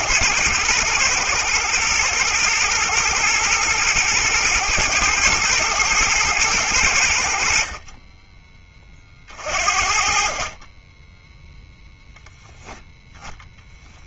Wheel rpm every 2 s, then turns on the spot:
120, 120, 110, 110, 20, 20, 10.
none